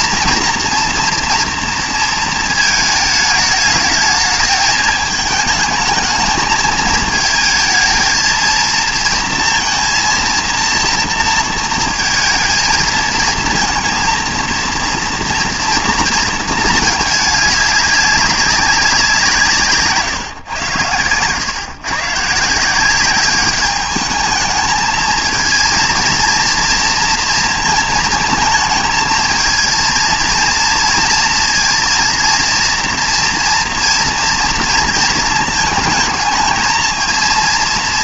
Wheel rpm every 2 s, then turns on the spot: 240, 220, 220, 220, 230, 230, 220, 230, 220, 190, 130, 170, 220, 230, 220, 230, 230, 230, 220.
none